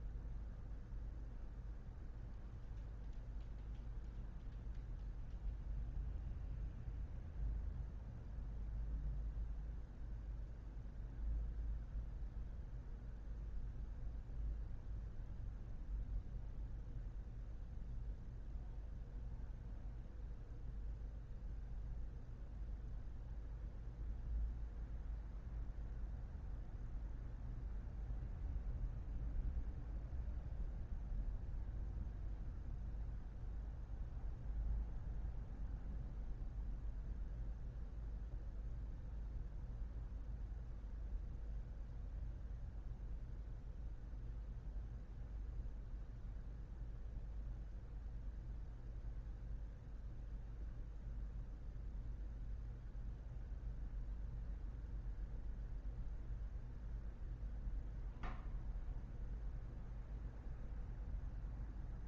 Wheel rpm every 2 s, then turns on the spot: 0, 0, 0, 0, 0, 0, 0, 0, 0, 0, 0, 0, 0, 0, 0, 0, 0, 0, 0, 0, 0, 0, 0, 0, 0, 0, 0, 0, 0, 0, 0.
none